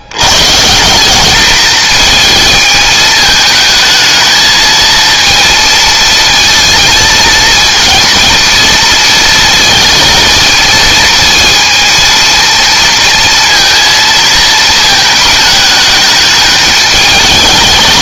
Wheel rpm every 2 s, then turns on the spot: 180, 220, 230, 230, 230, 230, 230, 220, 210.
none